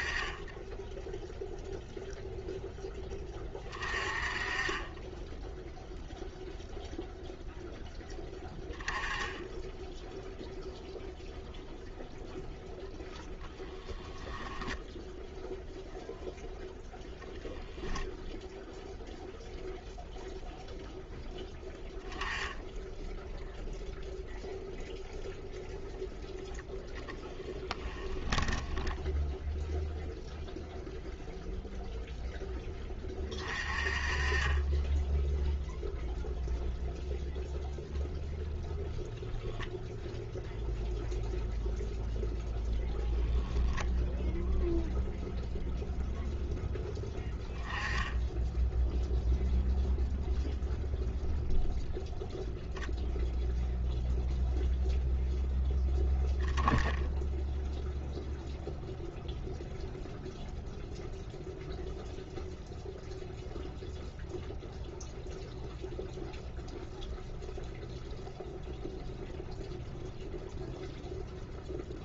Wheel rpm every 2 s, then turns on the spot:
0, 10, 10, 0, 10, 0, 0, 10, 0, 0, 0, 0, 0, 20, 20, 0, 20, 10, 0, 0, 0, 10, 0, 10, 0, 0, 0, 0, 0, 0, 0, 0, 0, 0, 0, 0.
14-16 26-30